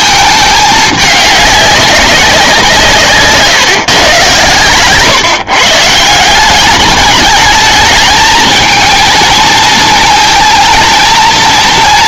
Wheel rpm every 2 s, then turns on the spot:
210, 170, 120, 190, 220, 230.
none